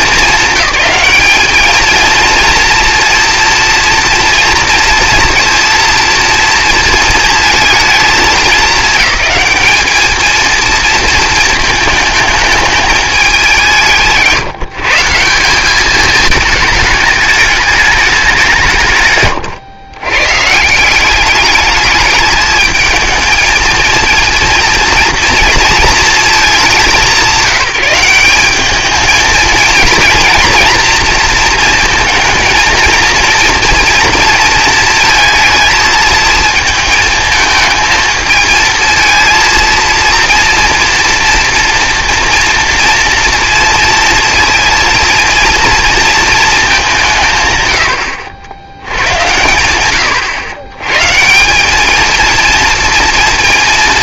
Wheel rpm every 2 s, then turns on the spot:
200, 230, 230, 230, 210, 230, 210, 160, 210, 140, 180, 220, 230, 200, 210, 240, 230, 220, 220, 230, 230, 230, 230, 190, 90, 120, 230.
none